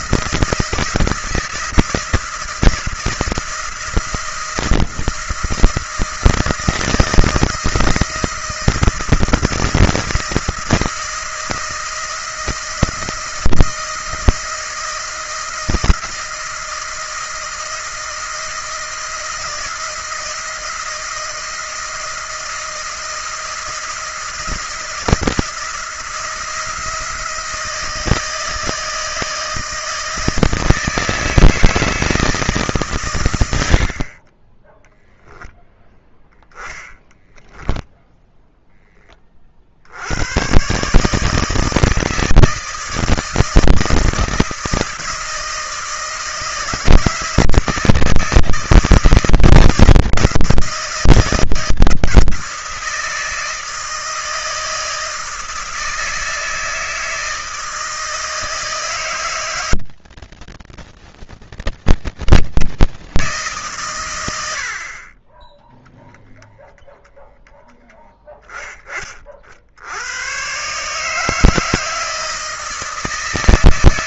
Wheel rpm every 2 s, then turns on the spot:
170, 160, 170, 160, 170, 160, 170, 160, 160, 170, 170, 160, 160, 170, 160, 160, 140, 10, 10, 10, 130, 160, 160, 160, 160, 160, 160, 160, 160, 160, 160, 160, 50, 0, 30, 150, 160.
34-36